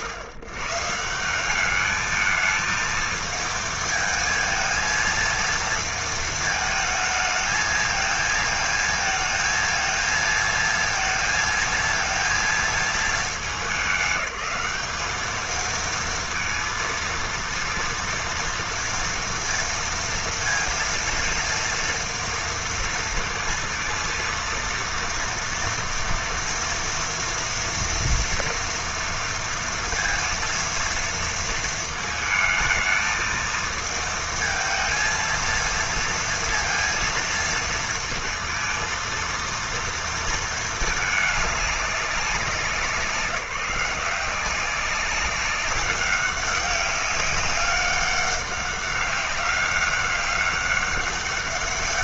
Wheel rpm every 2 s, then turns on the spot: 120, 220, 220, 220, 220, 230, 230, 200, 230, 230, 230, 230, 230, 230, 230, 230, 220, 220, 230, 230, 220, 180, 190, 190, 200, 200.
none